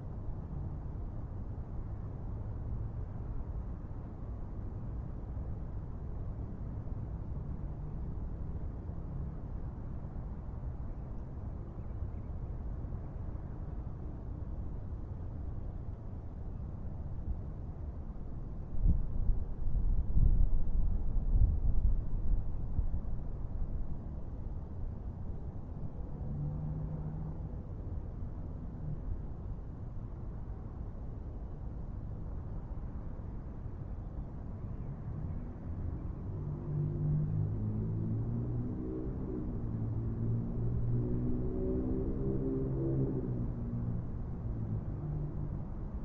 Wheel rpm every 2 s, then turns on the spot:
0, 0, 0, 0, 0, 0, 0, 0, 0, 0, 0, 0, 0, 0, 0, 0, 0, 0, 0, 0, 0, 0, 0.
none